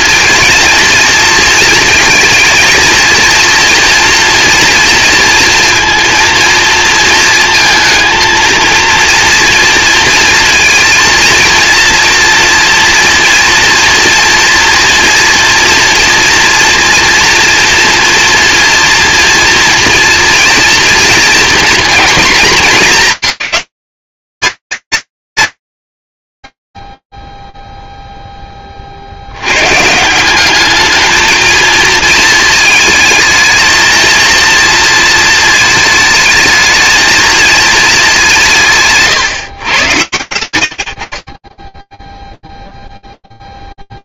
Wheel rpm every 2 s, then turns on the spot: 230, 230, 230, 230, 230, 230, 230, 230, 230, 230, 230, 200, 190, 10, 30, 200, 220, 230, 220, 170, 90, 0.
none